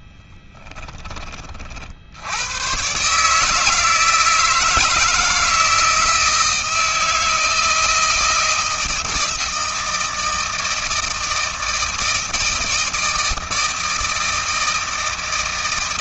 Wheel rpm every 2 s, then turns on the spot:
20, 130, 160, 160, 160, 160, 160, 160.
none